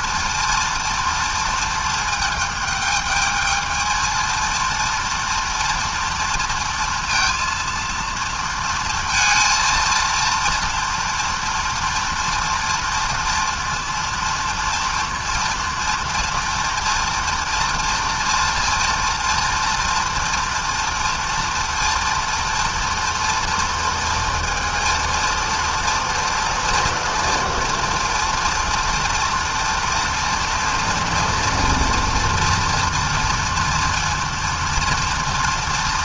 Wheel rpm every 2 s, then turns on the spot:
230, 220, 230, 230, 230, 230, 230, 230, 230, 230, 230, 230, 230, 230, 230, 230, 230, 240.
none